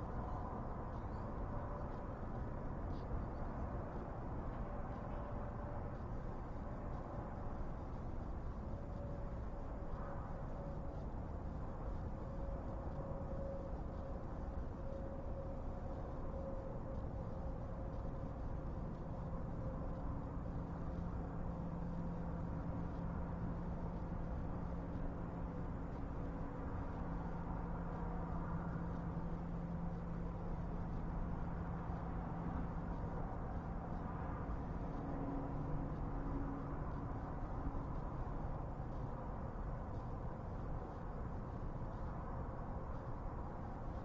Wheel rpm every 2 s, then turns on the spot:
0, 0, 0, 0, 0, 0, 0, 0, 0, 0, 0, 0, 0, 0, 0, 0, 0, 0, 0, 0, 0, 0.
none